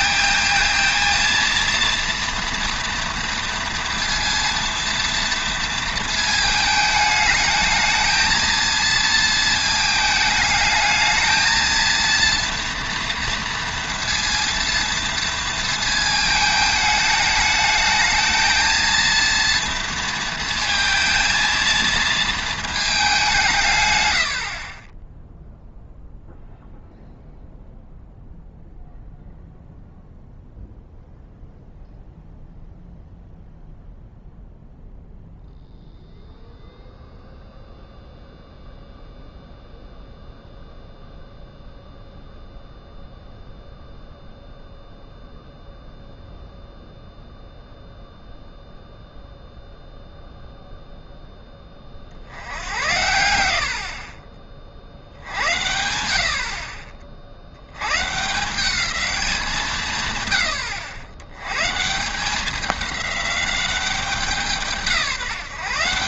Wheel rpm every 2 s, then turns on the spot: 230, 230, 230, 220, 230, 220, 230, 230, 220, 230, 230, 220, 50, 0, 0, 0, 0, 0, 0, 0, 0, 0, 0, 0, 0, 0, 90, 40, 50, 180, 100, 200, 170.
24-26